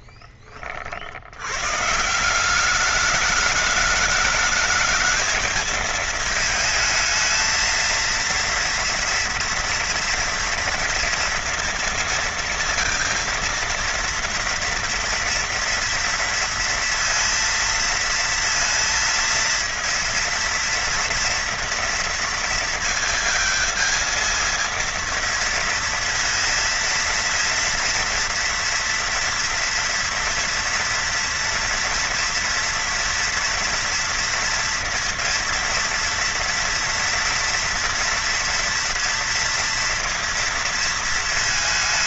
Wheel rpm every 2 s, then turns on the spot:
30, 180, 210, 220, 230, 230, 220, 230, 230, 230, 230, 230, 230, 230, 230, 230, 230, 230, 230, 230, 230.
none